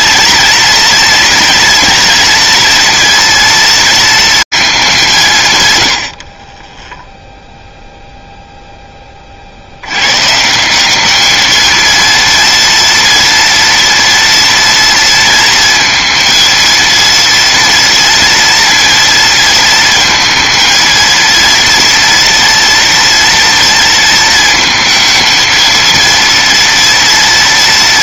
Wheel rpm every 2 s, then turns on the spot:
230, 230, 180, 10, 0, 160, 230, 230, 230, 230, 230, 230, 230, 230.
none